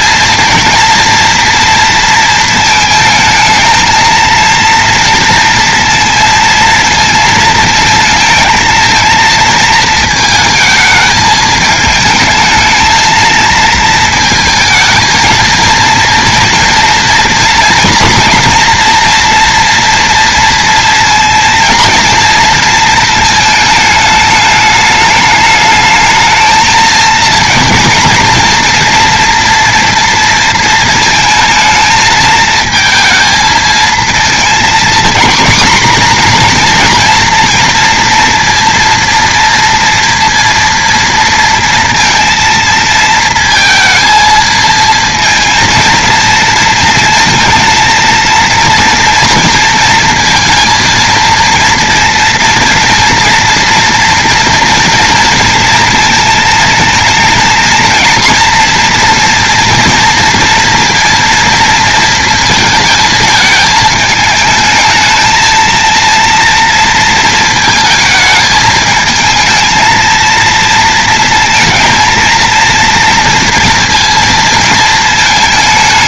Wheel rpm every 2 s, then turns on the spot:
230, 220, 230, 230, 230, 220, 220, 230, 230, 230, 230, 220, 210, 230, 230, 220, 220, 230, 230, 230, 230, 220, 230, 230, 230, 230, 230, 230, 230, 230, 230, 220, 220, 230, 220, 220, 230, 220.
none